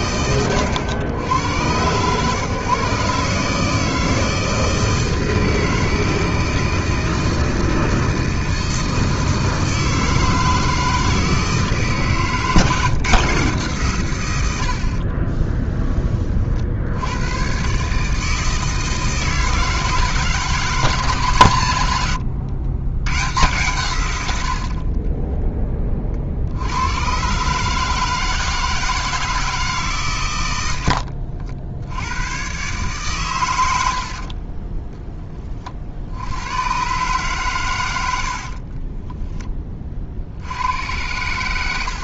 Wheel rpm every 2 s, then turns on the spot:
100, 140, 160, 160, 160, 160, 150, 60, 70, 160, 150, 120, 50, 90, 160, 90, 130, 20, 120, 40, 90.
14-16 30-32 38-40